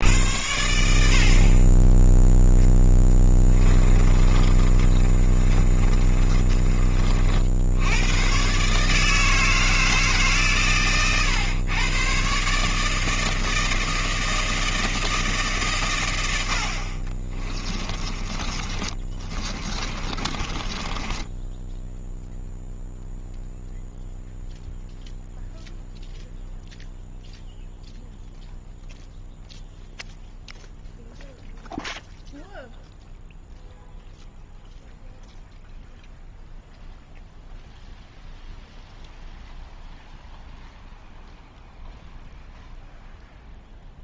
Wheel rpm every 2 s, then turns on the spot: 80, 10, 30, 40, 150, 120, 150, 160, 50, 30, 20, 0, 0, 0, 0, 0, 0, 0, 0, 0, 0, 0.
2-6 18-22